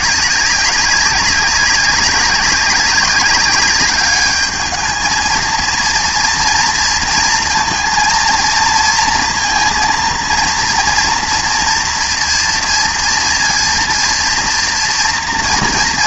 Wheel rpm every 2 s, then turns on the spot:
190, 200, 210, 230, 230, 230, 230, 230.
none